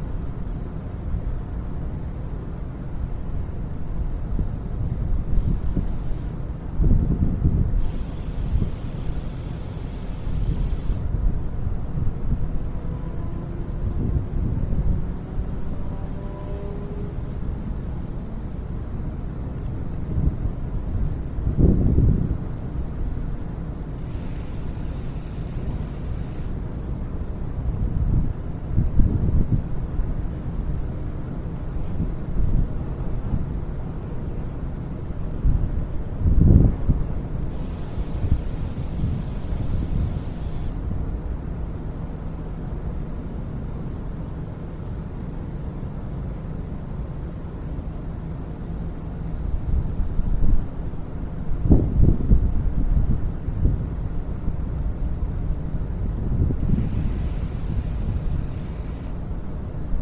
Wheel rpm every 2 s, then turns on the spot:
0, 0, 0, 0, 0, 0, 0, 0, 0, 0, 0, 0, 0, 0, 0, 0, 0, 0, 0, 0, 0, 0, 0, 0, 0, 0, 0, 0, 0, 0.
none